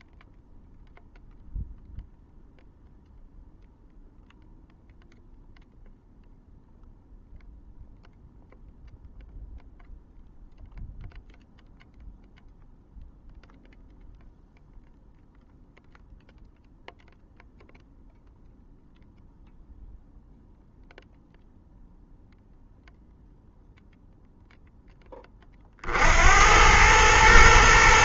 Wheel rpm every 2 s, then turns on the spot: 0, 0, 0, 0, 0, 0, 0, 0, 0, 0, 0, 0, 10, 110.
none